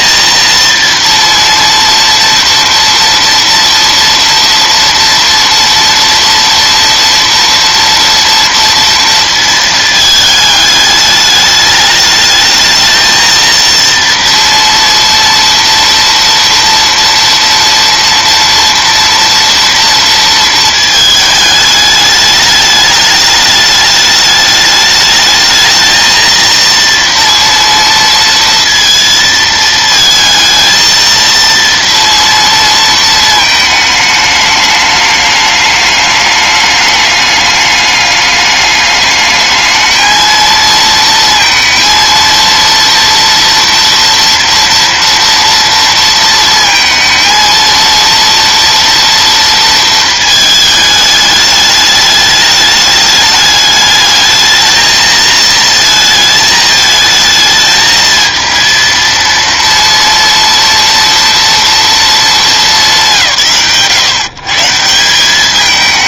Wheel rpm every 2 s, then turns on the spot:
230, 230, 230, 230, 230, 210, 220, 230, 230, 230, 220, 210, 210, 230, 230, 230, 230, 210, 210, 210, 230, 230, 230, 230, 230, 210, 210, 220, 220, 230, 230, 160, 170.
none